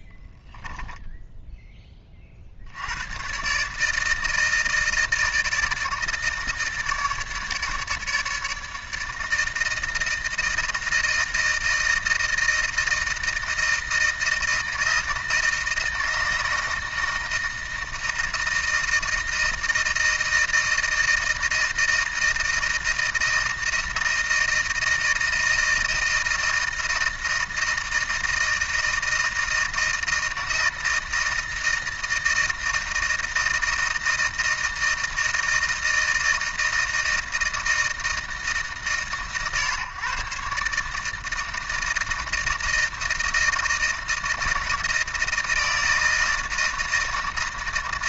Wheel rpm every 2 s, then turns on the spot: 0, 80, 160, 150, 150, 160, 160, 160, 160, 160, 160, 160, 160, 160, 160, 160, 160, 160, 160, 140, 140, 160, 160, 160.
none